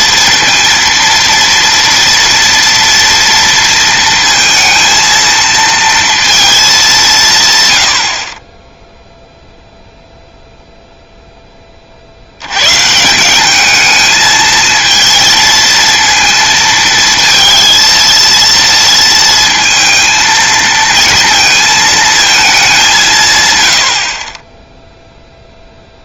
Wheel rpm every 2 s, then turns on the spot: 230, 230, 230, 200, 0, 0, 140, 220, 220, 230, 230, 190, 10.
none